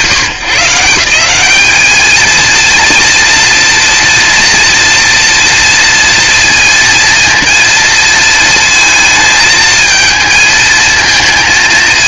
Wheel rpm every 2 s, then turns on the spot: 160, 230, 240, 230, 230, 220.
none